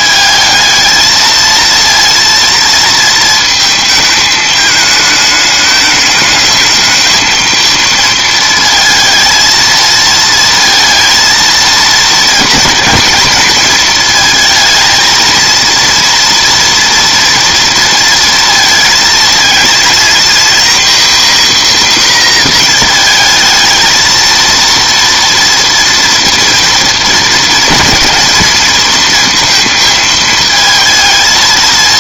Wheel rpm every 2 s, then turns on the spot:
220, 230, 210, 220, 230, 230, 220, 220, 230, 230, 240, 230, 230, 230, 230, 220.
none